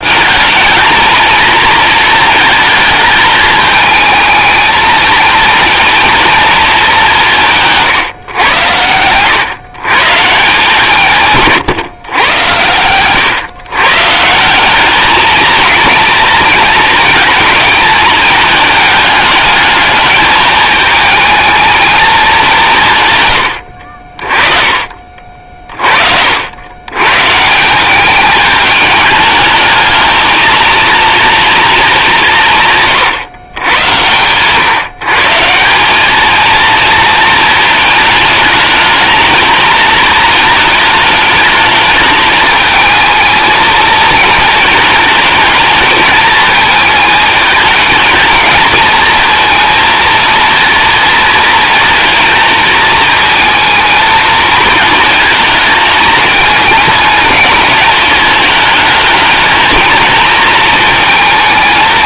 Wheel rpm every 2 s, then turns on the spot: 220, 220, 220, 220, 100, 160, 120, 200, 230, 220, 220, 150, 30, 90, 210, 230, 150, 140, 230, 220, 210, 220, 220, 220, 220, 240, 220, 220, 220, 210, 220.
none